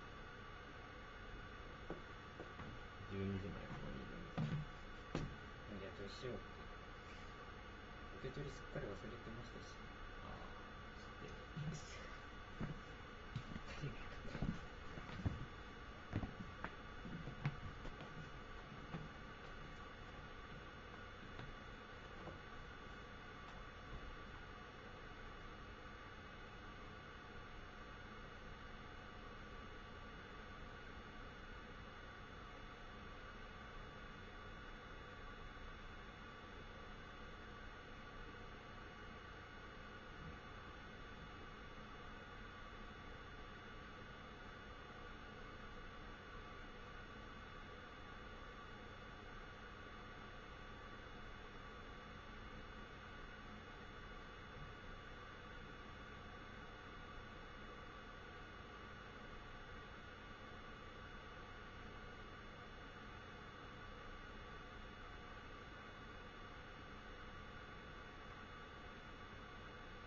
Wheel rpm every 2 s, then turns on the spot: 0, 0, 0, 0, 0, 0, 0, 0, 0, 0, 0, 0, 0, 0, 0, 0, 0, 0, 0, 0, 0, 0, 0, 0, 0, 0, 0, 0, 0, 0, 0, 0, 0, 0, 0.
none